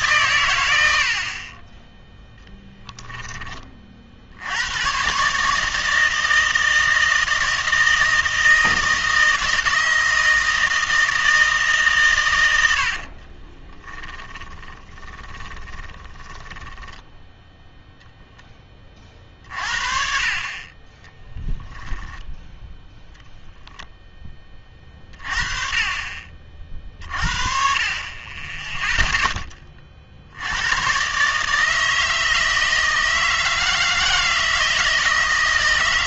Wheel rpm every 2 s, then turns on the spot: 80, 10, 110, 160, 160, 160, 80, 20, 10, 20, 30, 10, 30, 50, 10, 100, 160, 160.
2-4 14-18